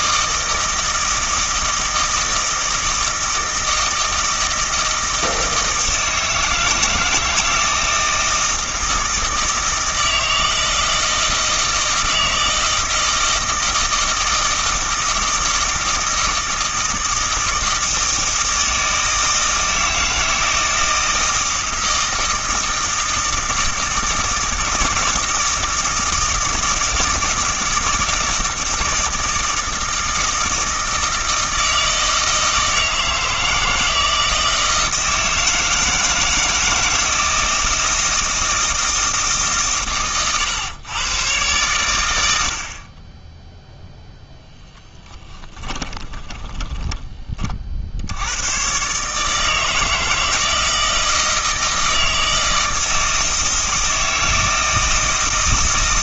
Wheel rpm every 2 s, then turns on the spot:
160, 160, 160, 160, 160, 160, 160, 160, 160, 160, 160, 160, 160, 160, 160, 160, 160, 160, 160, 160, 110, 40, 20, 10, 130, 160, 160, 160.
none